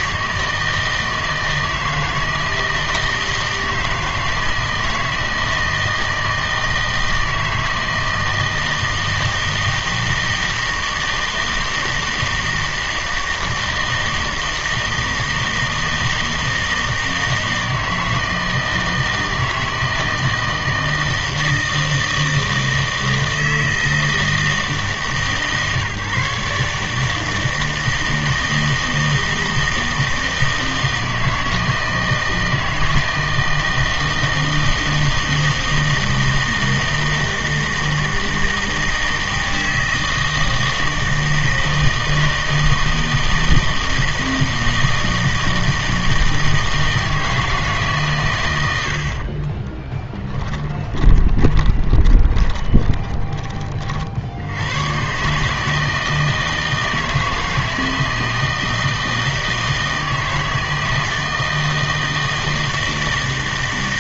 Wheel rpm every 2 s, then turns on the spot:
160, 160, 160, 160, 160, 160, 160, 160, 160, 160, 160, 160, 160, 150, 160, 160, 160, 160, 160, 160, 160, 160, 160, 160, 90, 20, 30, 90, 160, 160, 160, 160.
50-54